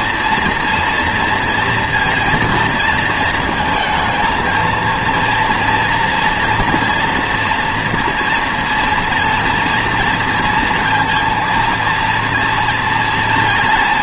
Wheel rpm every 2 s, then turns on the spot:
230, 230, 230, 240, 230, 230, 240.
none